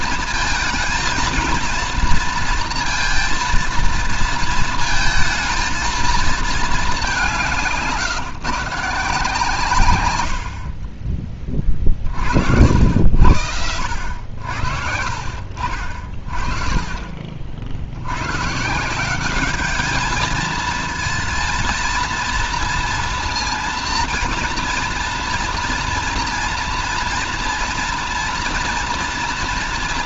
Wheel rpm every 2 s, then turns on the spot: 220, 230, 230, 210, 160, 40, 70, 70, 30, 160, 220, 230, 240, 230, 230.
none